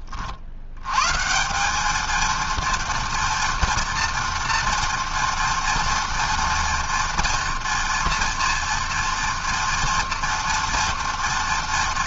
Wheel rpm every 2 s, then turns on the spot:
170, 230, 230, 230, 230, 230.
none